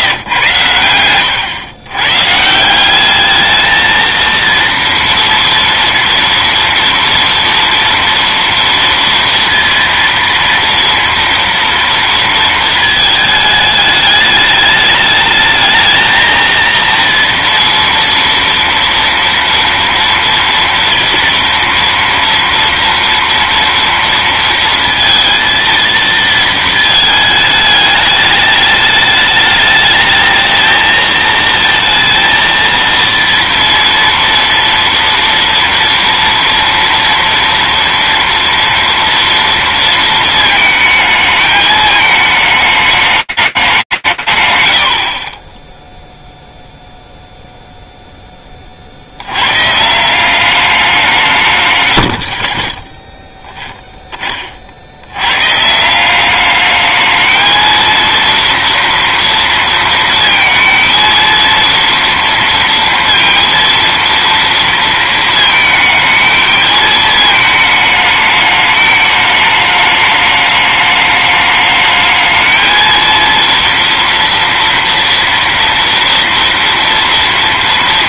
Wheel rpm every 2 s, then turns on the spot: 100, 180, 230, 230, 230, 230, 220, 210, 230, 230, 230, 230, 230, 220, 210, 220, 230, 230, 230, 230, 220, 210, 110, 0, 50, 190, 20, 90, 220, 230, 230, 230, 230, 220, 210, 210, 230, 230, 230.
none